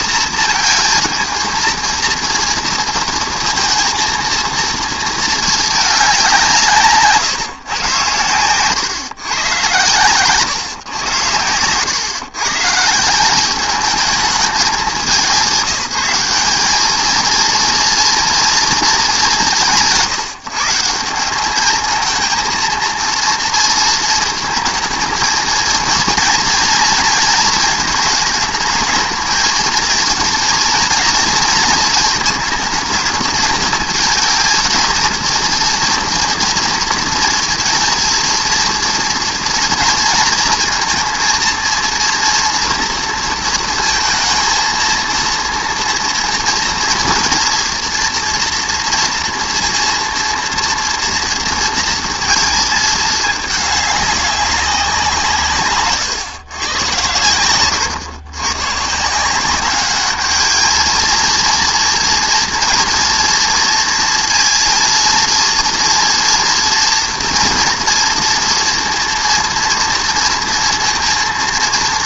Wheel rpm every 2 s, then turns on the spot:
230, 230, 230, 160, 120, 130, 150, 210, 210, 220, 170, 230, 230, 230, 220, 230, 220, 220, 230, 230, 230, 230, 230, 230, 240, 230, 220, 180, 120, 130, 220, 230, 230, 230, 230, 230.
none